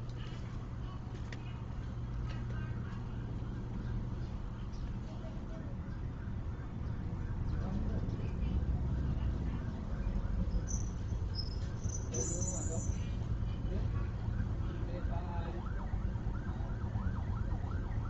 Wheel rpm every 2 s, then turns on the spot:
0, 0, 0, 0, 0, 0, 0, 0, 0.
none